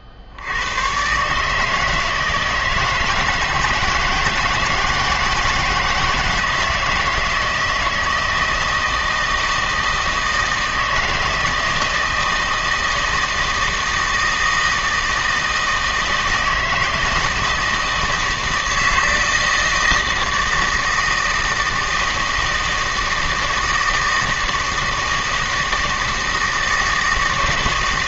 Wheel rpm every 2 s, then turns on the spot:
100, 160, 160, 160, 160, 160, 160, 160, 160, 160, 160, 160, 160, 160.
none